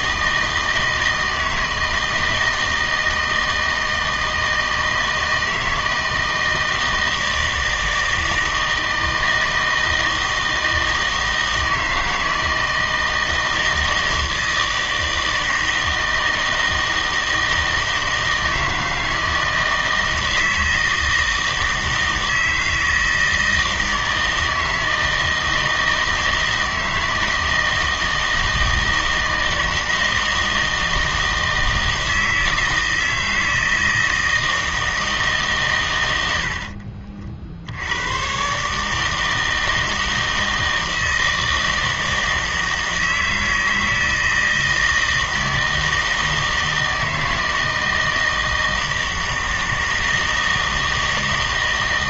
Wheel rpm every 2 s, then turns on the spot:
160, 160, 160, 160, 160, 160, 160, 160, 160, 160, 160, 160, 160, 160, 160, 160, 160, 160, 60, 140, 160, 160, 160, 160, 160, 160.
36-38